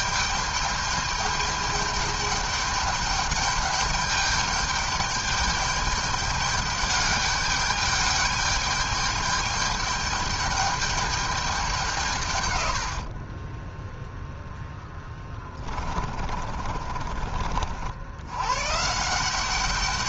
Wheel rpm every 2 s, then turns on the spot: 210, 210, 210, 210, 210, 210, 120, 0, 50, 120.
16-18